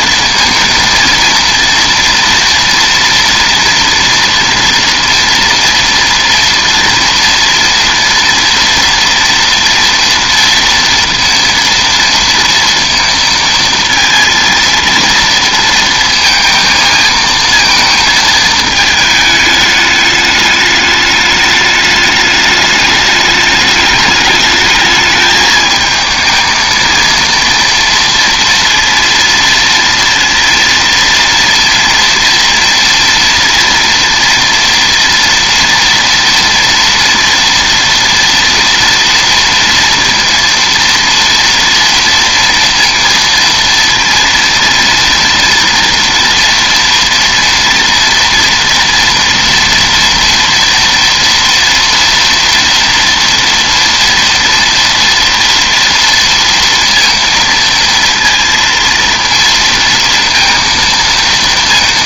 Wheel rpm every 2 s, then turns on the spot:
230, 230, 230, 230, 230, 230, 230, 230, 230, 220, 210, 210, 210, 230, 230, 230, 240, 230, 230, 230, 230, 230, 230, 230, 240, 230, 230, 230, 230, 230, 230.
none